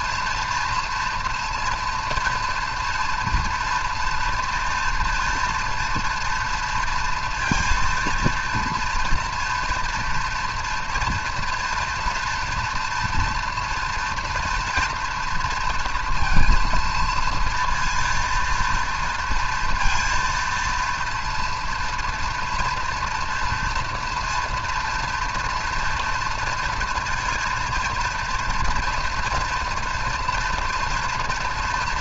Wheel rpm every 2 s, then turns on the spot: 230, 230, 230, 230, 230, 230, 230, 230, 230, 230, 230, 230, 230, 240, 230, 230.
none